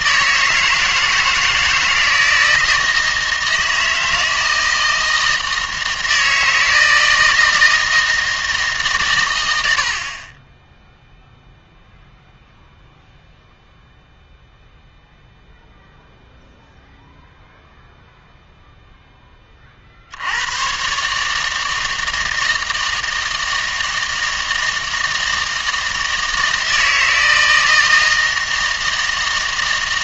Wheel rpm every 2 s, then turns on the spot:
160, 160, 160, 160, 150, 10, 0, 0, 0, 0, 120, 160, 160, 160, 160.
none